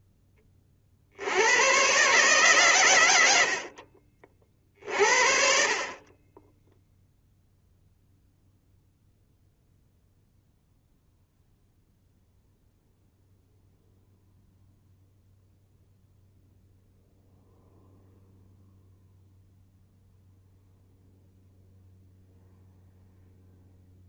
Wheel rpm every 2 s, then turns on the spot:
30, 130, 50, 10, 0, 0, 0, 0, 0, 0, 0, 0.
none